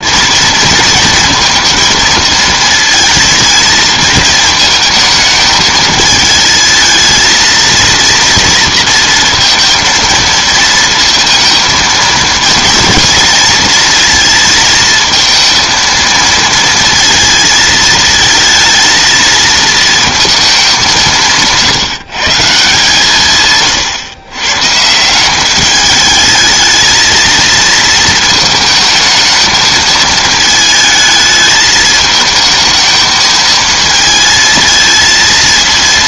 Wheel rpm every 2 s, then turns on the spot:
230, 230, 230, 220, 230, 230, 230, 220, 230, 230, 200, 160, 130, 220, 220, 220, 220, 220.
none